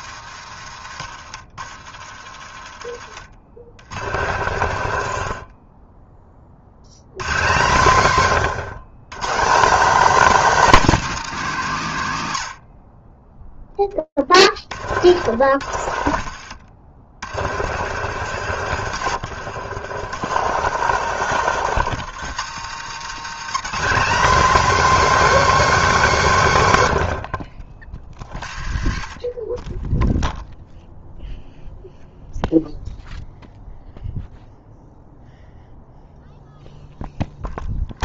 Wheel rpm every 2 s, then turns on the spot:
100, 60, 80, 60, 150, 280, 90, 60, 70, 100, 120, 150, 280, 150, 50, 0, 0, 0, 0.
4-6 14-18 20-24 28-30